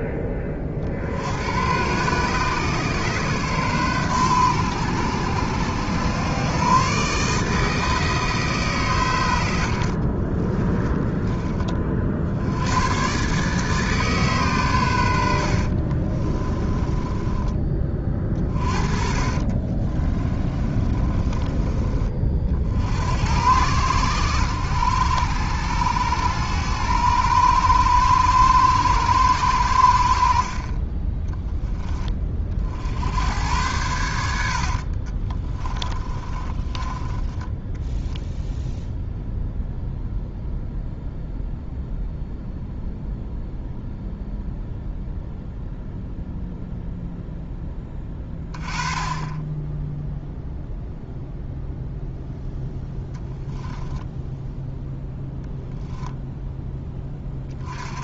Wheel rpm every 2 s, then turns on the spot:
30, 140, 110, 130, 140, 20, 110, 110, 20, 40, 30, 50, 100, 100, 110, 30, 60, 60, 20, 0, 0, 0, 0, 0, 20, 0, 10, 10, 10.
10-12 16-22 34-38